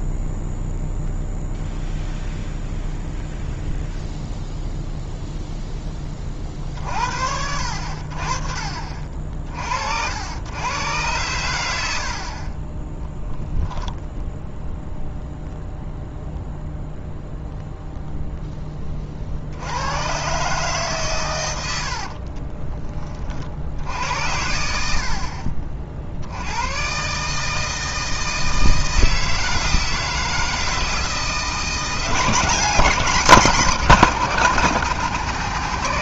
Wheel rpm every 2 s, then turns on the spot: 0, 0, 0, 50, 40, 110, 20, 0, 0, 10, 140, 30, 70, 120, 160, 160, 180, 220.
22-24